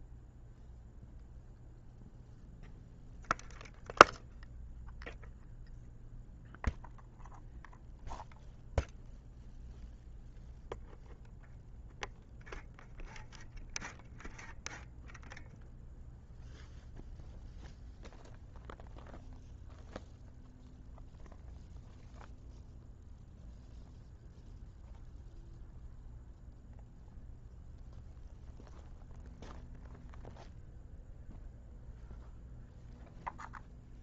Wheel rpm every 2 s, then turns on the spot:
0, 0, 0, 0, 0, 0, 0, 0, 0, 0, 0, 0, 0, 0, 0, 0, 0.
none